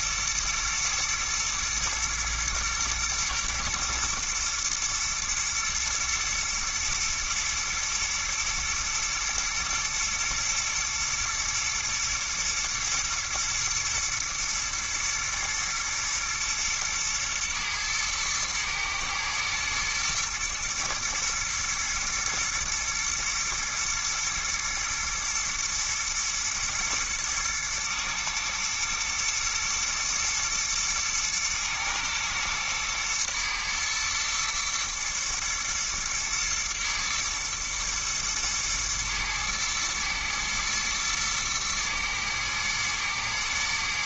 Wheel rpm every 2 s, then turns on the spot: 110, 110, 110, 110, 120, 120, 120, 110, 110, 110, 110, 120, 110, 110, 120, 110, 110, 110, 120, 110, 110, 110.
none